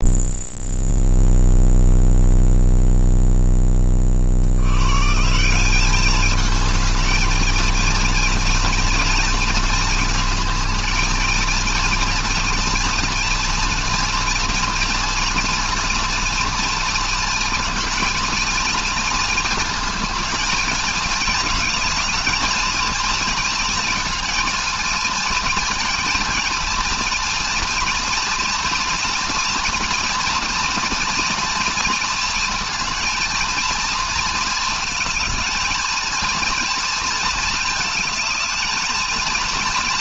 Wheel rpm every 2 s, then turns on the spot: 0, 0, 130, 220, 230, 220, 230, 230, 230, 220, 220, 230, 230, 230, 230, 240, 220, 220, 230, 220.
none